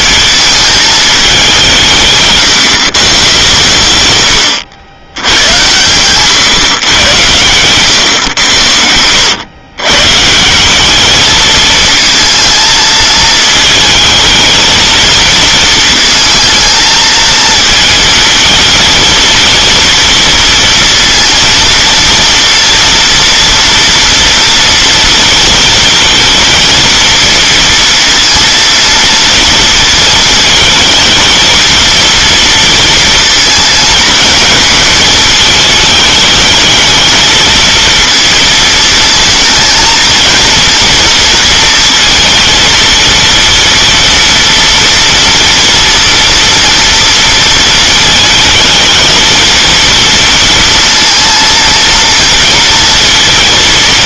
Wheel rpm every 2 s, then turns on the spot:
220, 140, 90, 130, 100, 180, 220, 220, 220, 220, 230, 230, 230, 220, 230, 220, 230, 220, 220, 220, 230, 230, 230, 230, 220, 230, 230.
none